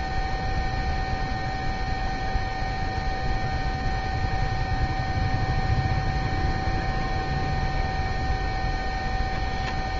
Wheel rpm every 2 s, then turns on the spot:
0, 0, 0, 0, 0.
none